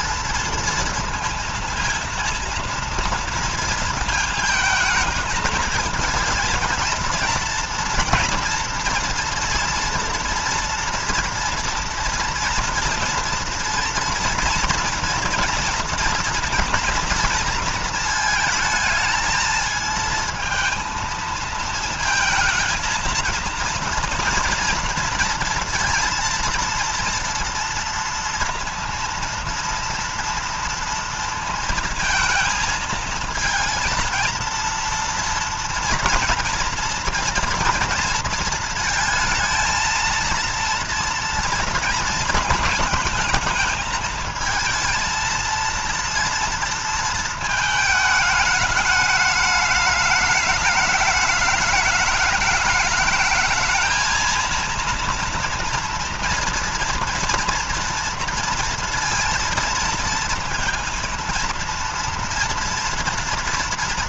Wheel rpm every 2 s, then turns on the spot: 230, 230, 220, 230, 230, 230, 230, 230, 230, 220, 230, 230, 230, 230, 230, 230, 230, 230, 230, 230, 230, 230, 220, 230, 210, 210, 210, 230, 230, 230, 230, 230.
none